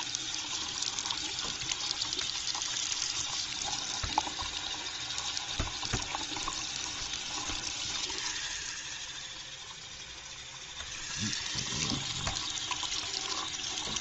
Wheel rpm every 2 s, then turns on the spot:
0, 0, 0, 0, 0, 0, 0.
none